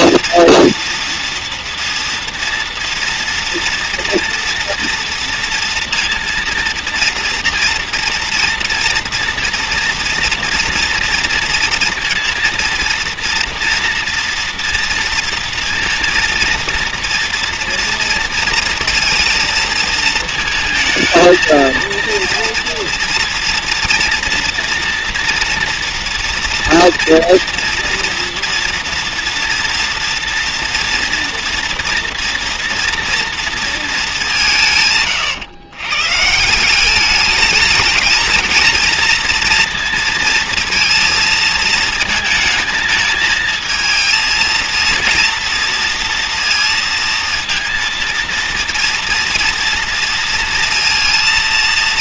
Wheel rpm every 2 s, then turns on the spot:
240, 230, 230, 230, 230, 230, 230, 230, 230, 230, 220, 230, 230, 230, 230, 230, 230, 160, 180, 230, 230, 220, 230, 230, 230, 230.
none